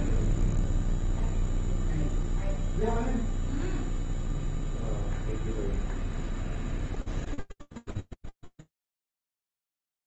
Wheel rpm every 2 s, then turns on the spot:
0, 0, 0, 0, 0.
none